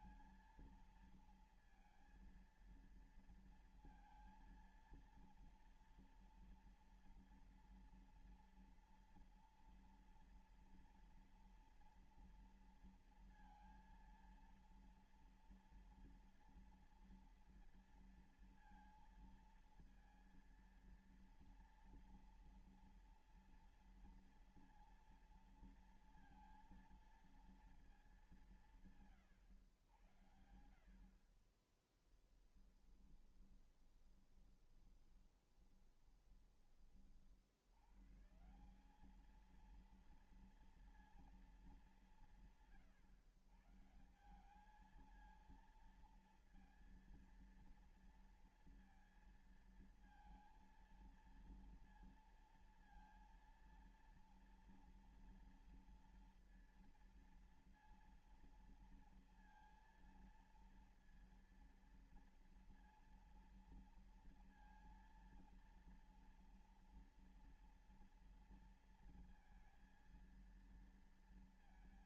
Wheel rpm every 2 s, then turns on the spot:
230, 230, 230, 230, 230, 230, 230, 230, 230, 230, 230, 240, 230, 230, 180, 80, 10, 20, 20, 150, 230, 160, 180, 230, 230, 230, 230, 230, 230, 230, 230, 230, 230, 230, 230, 230.
32-38